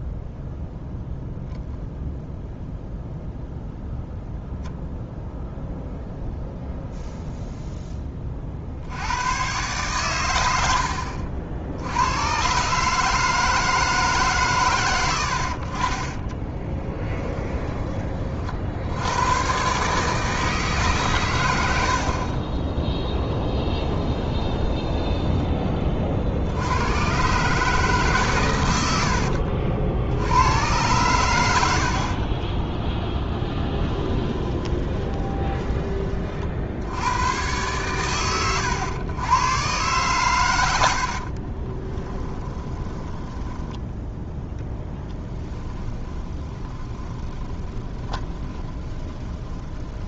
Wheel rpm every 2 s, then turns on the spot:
0, 0, 0, 0, 60, 80, 140, 120, 20, 70, 150, 10, 10, 90, 100, 110, 10, 20, 50, 100, 90, 10, 10, 20, 20.
16-18 24-26 32-36 42-50